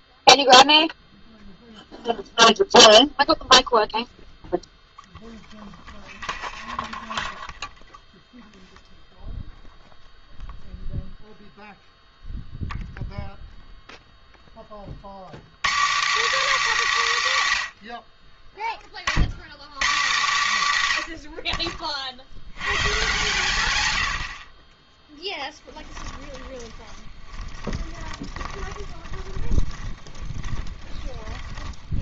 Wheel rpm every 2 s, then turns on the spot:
0, 0, 0, 0, 0, 0, 0, 60, 240, 30, 130, 120, 20, 30, 10, 10.
26-32